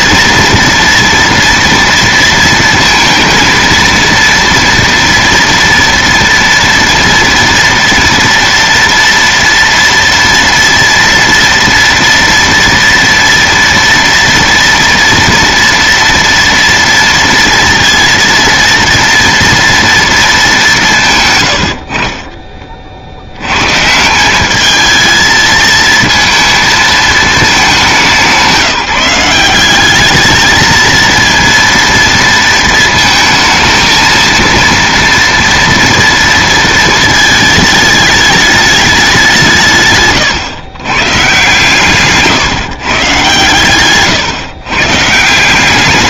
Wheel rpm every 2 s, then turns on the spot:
230, 230, 230, 230, 240, 230, 230, 230, 230, 230, 140, 60, 210, 220, 180, 230, 220, 230, 220, 200, 120, 130, 140.
none